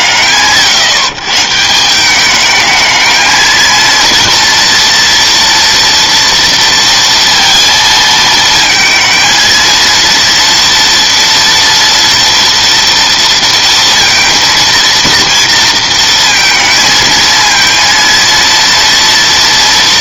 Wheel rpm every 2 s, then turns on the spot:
130, 220, 230, 230, 230, 230, 230, 230, 230, 230.
none